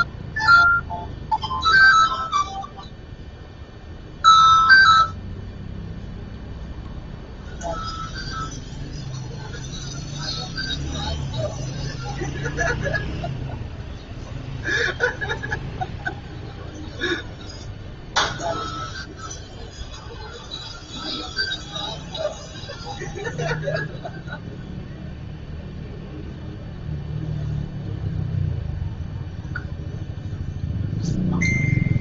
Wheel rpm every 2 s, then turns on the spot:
0, 0, 0, 0, 0, 0, 0, 0, 0, 0, 0, 0, 0, 0, 0, 0.
none